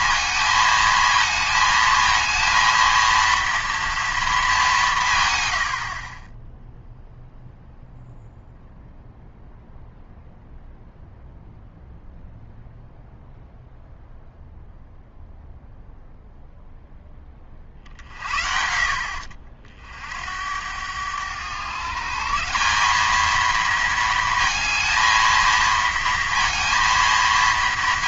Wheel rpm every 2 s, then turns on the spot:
220, 230, 190, 0, 0, 0, 0, 0, 0, 60, 90, 190, 230, 230.
none